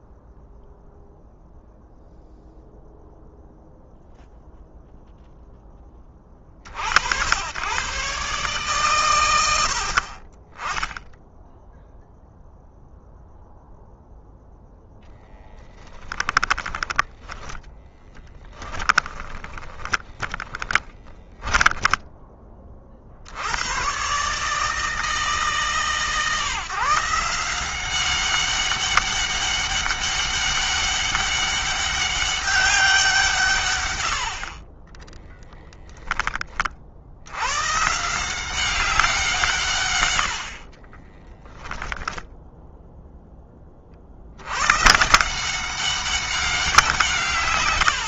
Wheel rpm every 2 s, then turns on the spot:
0, 0, 0, 50, 120, 10, 0, 0, 10, 20, 10, 40, 160, 170, 200, 200, 190, 40, 60, 190, 30, 0, 110, 170.
16-22 34-36 40-42